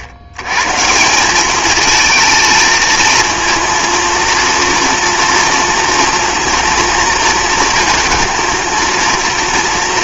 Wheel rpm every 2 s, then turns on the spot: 100, 230, 240, 240, 230.
none